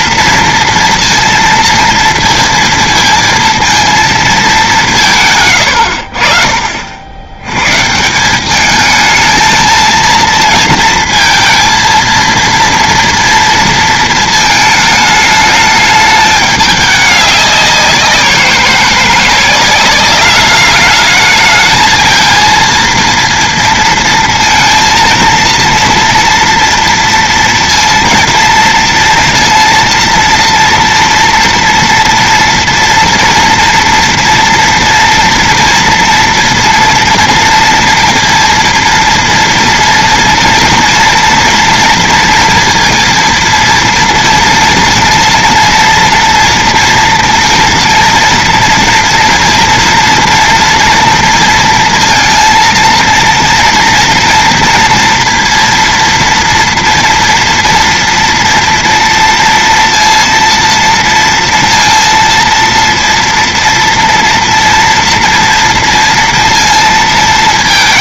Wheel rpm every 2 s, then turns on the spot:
230, 230, 210, 50, 210, 230, 230, 220, 210, 180, 200, 230, 230, 230, 230, 230, 230, 230, 230, 230, 230, 230, 230, 230, 230, 230, 230, 230, 240, 230, 230, 230, 230, 230.
none